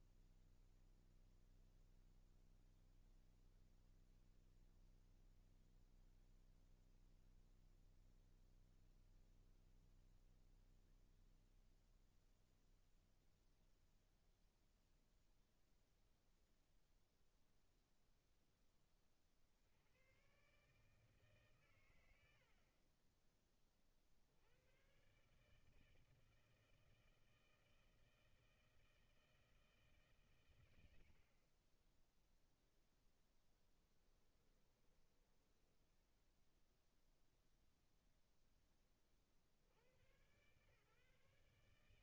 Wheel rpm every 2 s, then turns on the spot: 0, 0, 0, 0, 0, 0, 0, 0, 0, 0, 130, 80, 70, 160, 160, 130, 0, 10, 10, 0, 120.
34-36